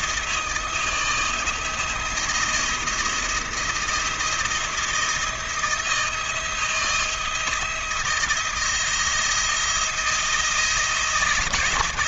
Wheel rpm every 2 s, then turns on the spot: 170, 170, 170, 170, 170, 160.
none